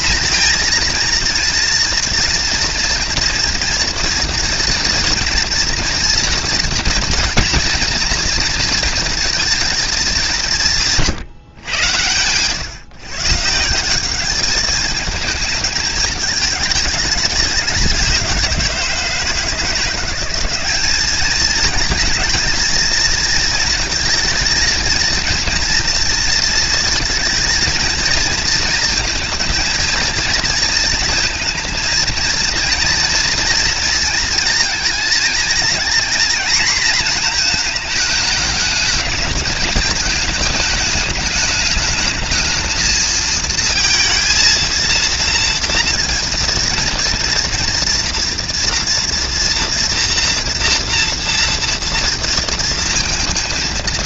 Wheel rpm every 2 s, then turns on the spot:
230, 240, 230, 240, 230, 160, 140, 210, 210, 170, 200, 220, 230, 230, 230, 230, 230, 220, 240, 220, 210, 220, 230, 230, 230, 230, 230.
none